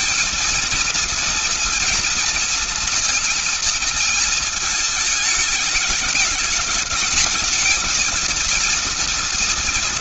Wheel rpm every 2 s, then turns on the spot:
220, 230, 220, 210, 230.
none